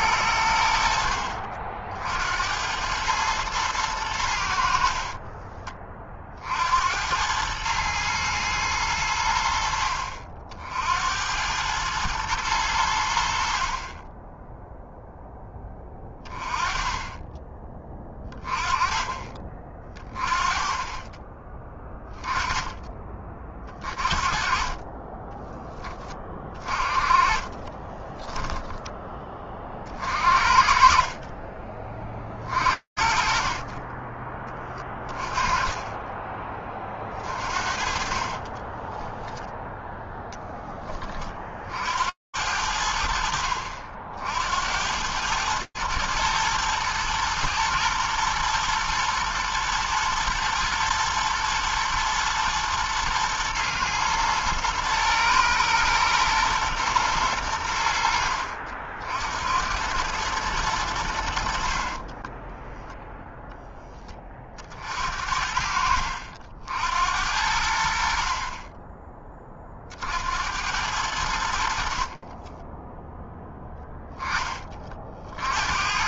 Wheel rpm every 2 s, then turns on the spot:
80, 70, 90, 40, 110, 60, 110, 20, 20, 20, 20, 20, 30, 20, 10, 50, 30, 20, 20, 40, 0, 70, 60, 110, 110, 110, 110, 110, 120, 70, 110, 20, 20, 60, 50, 70, 40, 10.
28-30 62-64 72-74